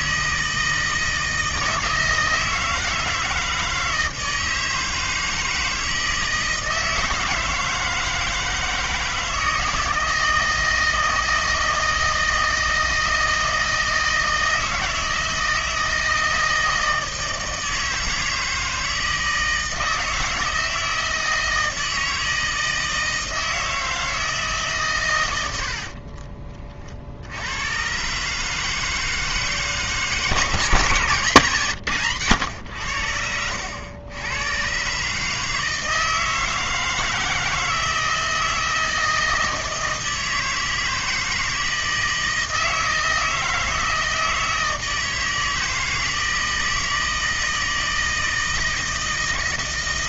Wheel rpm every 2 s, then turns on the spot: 160, 160, 160, 160, 160, 160, 160, 160, 160, 160, 160, 160, 150, 40, 150, 160, 90, 130, 160, 160, 160, 160, 160, 160, 160.
none